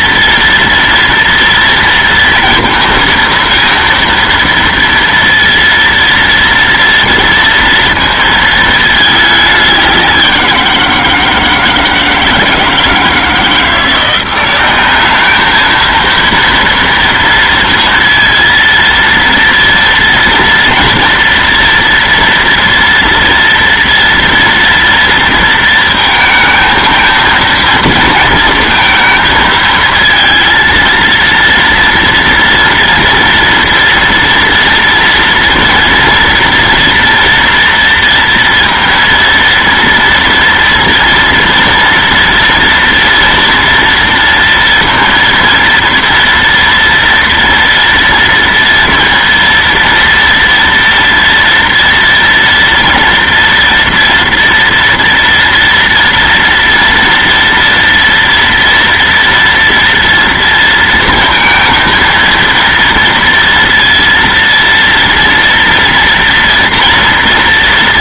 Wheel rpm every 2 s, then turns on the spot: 230, 230, 230, 230, 220, 170, 160, 200, 230, 230, 230, 230, 230, 230, 230, 230, 240, 230, 230, 230, 240, 230, 230, 230, 230, 230, 230, 240, 230, 230, 230, 230, 230, 230.
none